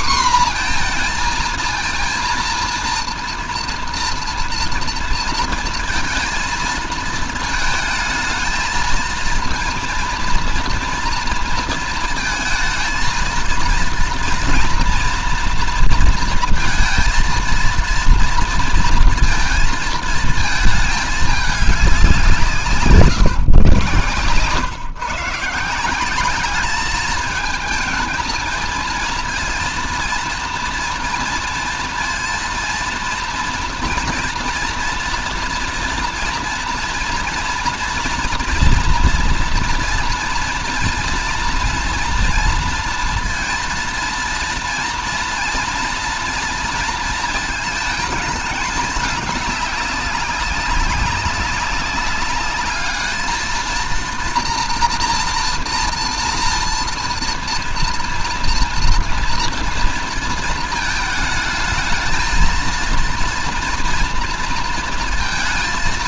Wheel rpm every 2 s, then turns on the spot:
230, 240, 230, 230, 220, 230, 220, 230, 230, 230, 220, 160, 130, 210, 220, 230, 230, 230, 230, 230, 230, 230, 230, 230, 210, 190, 210, 230, 230, 230, 220, 230, 230.
none